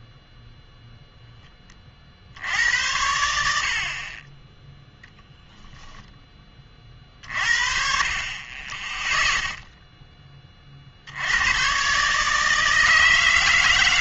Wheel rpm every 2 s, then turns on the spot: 0, 70, 10, 30, 20, 30, 160.
none